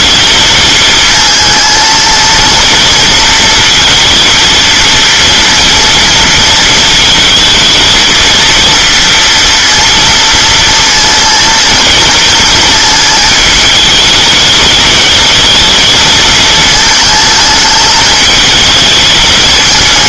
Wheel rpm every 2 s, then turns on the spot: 220, 230, 230, 230, 230, 230, 220, 210, 220, 220.
none